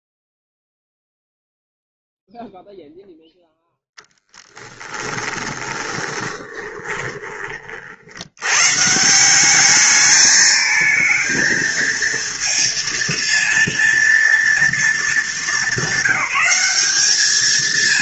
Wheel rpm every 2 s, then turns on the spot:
0, 0, 20, 20, 150, 220, 230, 220, 210.
4-8